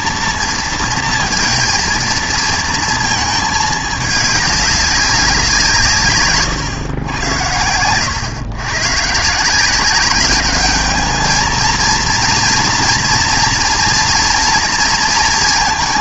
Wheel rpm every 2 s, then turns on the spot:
230, 230, 200, 120, 120, 210, 230, 230.
none